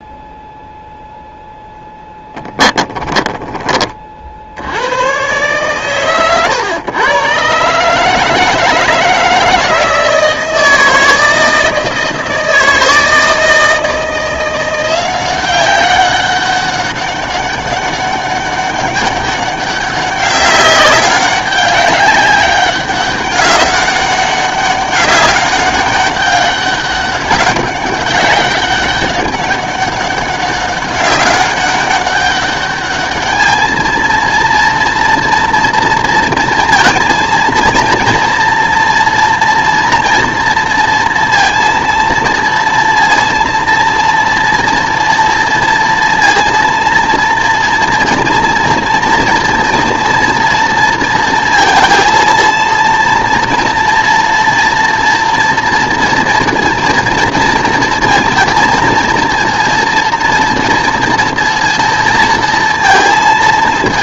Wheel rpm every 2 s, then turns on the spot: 0, 20, 80, 130, 160, 160, 160, 180, 200, 200, 200, 200, 200, 200, 200, 200, 210, 230, 230, 230, 230, 230, 230, 230, 230, 230, 230, 230, 230, 230, 230, 230.
2-4